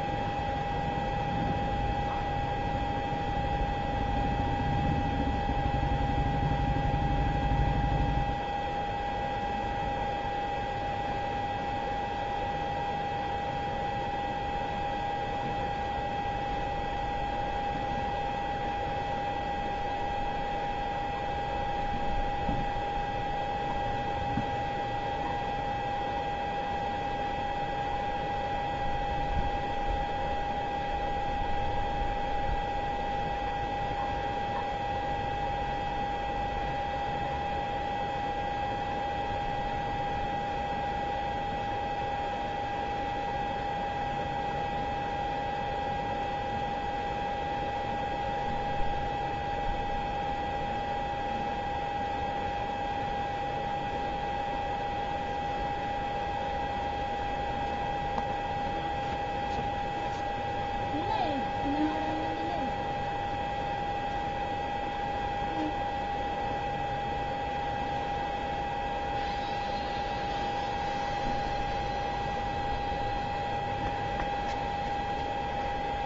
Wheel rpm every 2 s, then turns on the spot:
0, 0, 0, 0, 0, 0, 0, 0, 0, 0, 0, 0, 0, 0, 0, 0, 0, 0, 0, 0, 0, 0, 0, 0, 0, 0, 0, 0, 0, 0, 0, 0, 0, 0, 0, 0, 0, 0.
none